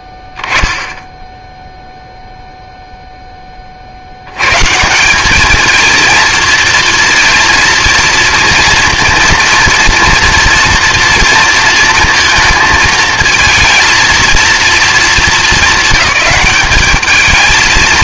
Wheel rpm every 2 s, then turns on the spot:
10, 0, 150, 230, 230, 230, 220, 220, 200.
none